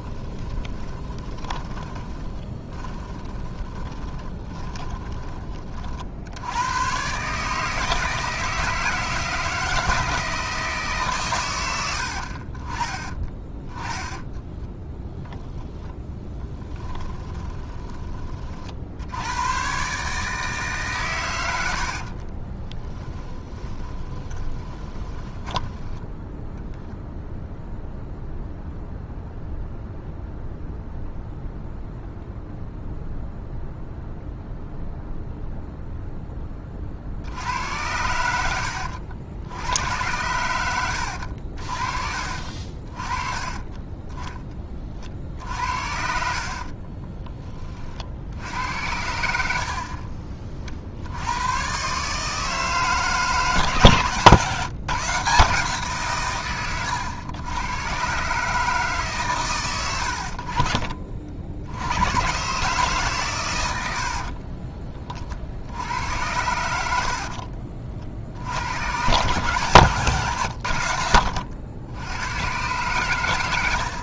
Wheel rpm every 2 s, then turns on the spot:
20, 20, 20, 100, 160, 150, 20, 10, 20, 60, 140, 20, 20, 0, 0, 0, 0, 0, 40, 80, 90, 40, 40, 40, 60, 60, 160, 140, 120, 150, 40, 140, 30, 90, 90, 70, 120.
0-6 16-18 22-26 46-48 66-68